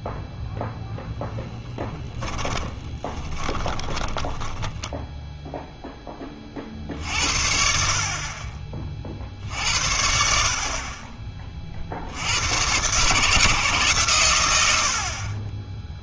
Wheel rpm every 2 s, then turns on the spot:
10, 20, 10, 50, 40, 30, 120, 80.
2-6